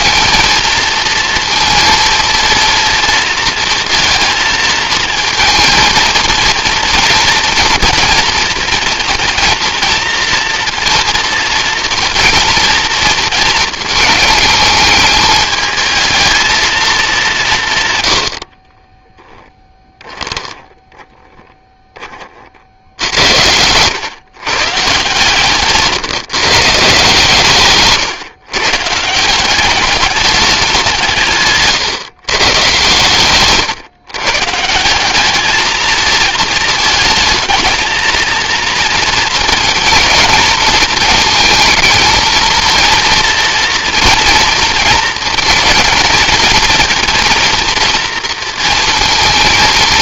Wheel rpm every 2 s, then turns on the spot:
230, 230, 230, 230, 230, 240, 220, 220, 140, 10, 10, 80, 140, 140, 180, 150, 130, 210, 220, 230, 220, 230, 230, 230, 230.
18-20